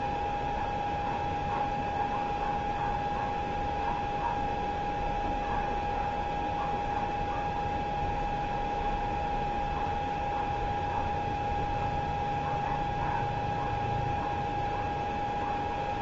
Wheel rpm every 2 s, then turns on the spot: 0, 0, 0, 0, 0, 0, 0, 0.
none